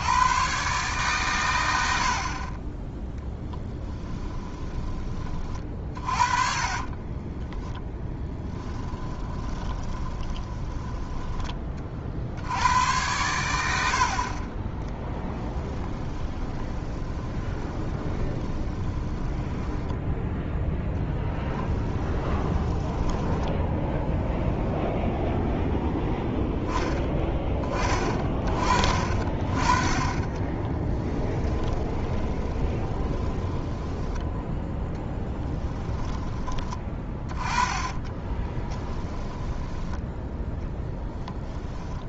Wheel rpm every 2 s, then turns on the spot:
130, 20, 20, 30, 20, 20, 90, 10, 20, 20, 0, 10, 0, 10, 30, 20, 20, 10, 20, 10, 10.
4-12 14-20 22-24 30-34 38-42